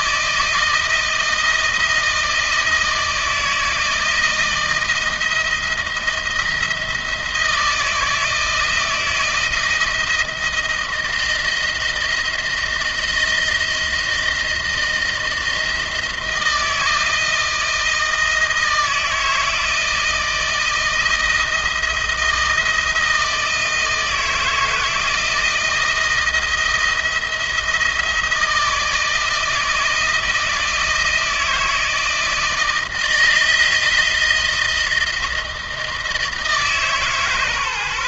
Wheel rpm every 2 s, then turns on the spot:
160, 160, 160, 170, 160, 160, 160, 160, 160, 160, 160, 160, 170, 170, 160, 170, 160, 160, 160.
none